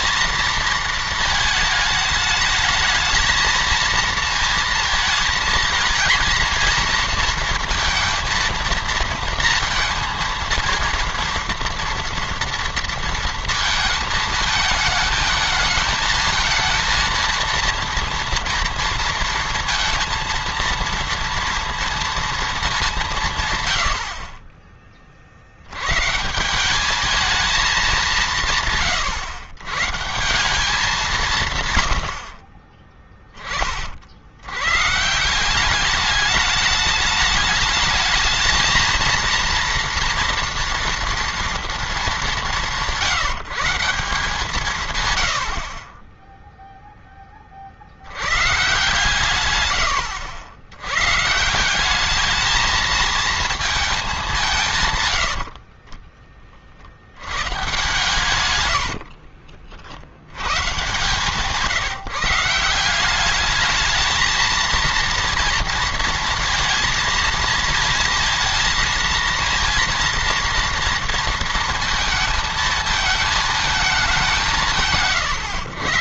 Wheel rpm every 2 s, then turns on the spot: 230, 220, 220, 230, 230, 230, 230, 220, 220, 230, 230, 210, 30, 200, 150, 190, 30, 120, 210, 220, 230, 190, 140, 0, 130, 110, 220, 150, 50, 100, 120, 170, 230, 230, 230, 230, 220, 160.
32-34 58-60